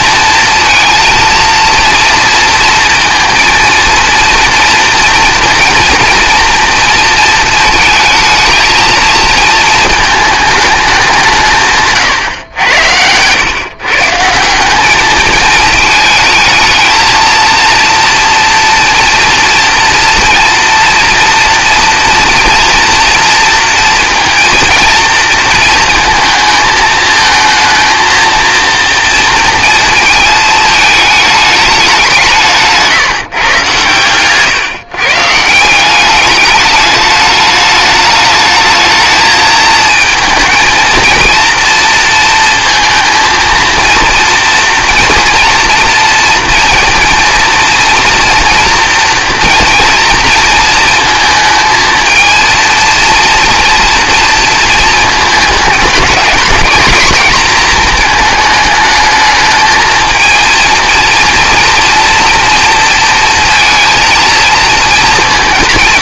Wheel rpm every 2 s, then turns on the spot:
230, 230, 230, 230, 220, 210, 100, 180, 220, 230, 230, 240, 230, 220, 230, 220, 160, 120, 210, 210, 230, 230, 230, 230, 230, 220, 230, 220, 220, 220, 230, 230, 230.
none